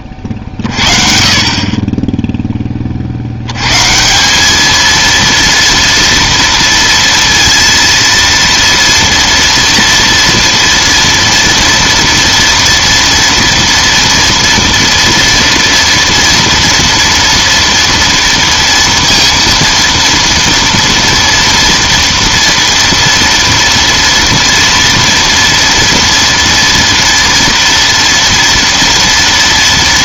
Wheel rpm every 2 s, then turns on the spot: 40, 30, 220, 230, 230, 230, 230, 230, 240, 230, 230, 230, 230, 230, 240.
none